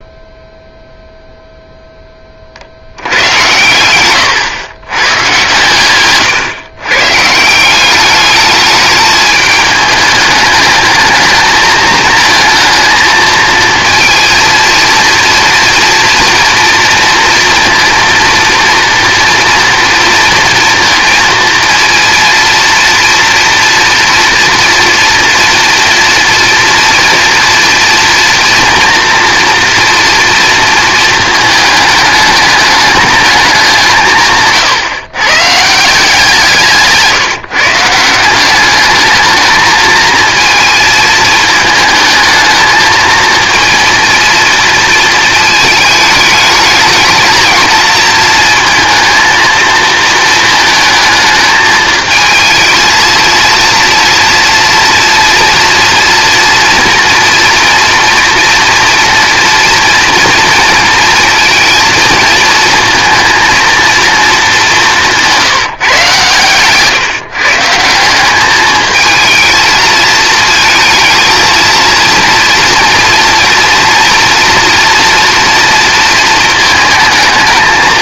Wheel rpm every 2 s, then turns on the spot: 0, 40, 120, 120, 210, 220, 220, 230, 230, 230, 230, 230, 230, 230, 230, 230, 210, 150, 170, 200, 220, 220, 230, 220, 230, 220, 220, 230, 230, 230, 230, 230, 200, 130, 210, 220, 230, 230, 220.
66-68